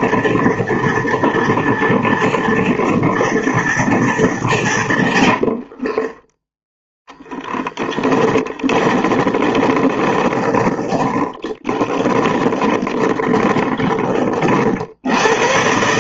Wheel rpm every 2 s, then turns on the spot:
230, 230, 160, 0, 20, 30, 30, 30.
8-14